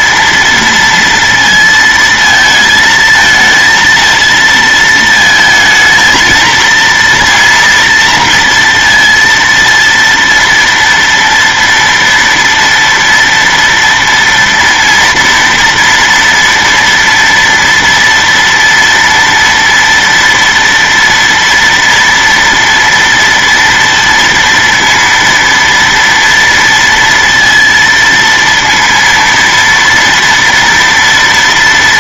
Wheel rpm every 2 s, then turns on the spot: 230, 220, 230, 230, 230, 230, 230, 230, 230, 230, 230, 230, 230, 230, 230, 230.
none